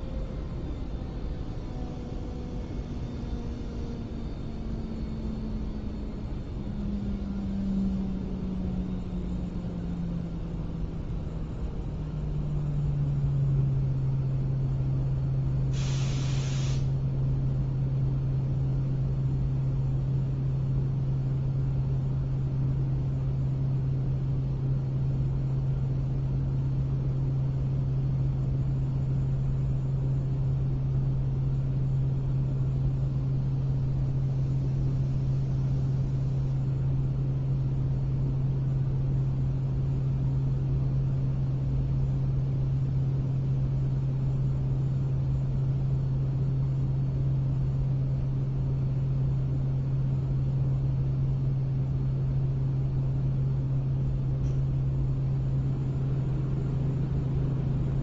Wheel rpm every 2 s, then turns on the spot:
0, 0, 0, 0, 0, 0, 0, 0, 0, 0, 0, 0, 0, 0, 0, 0, 0, 0, 0, 0, 0, 0, 0, 0, 0, 0, 0, 0, 0.
none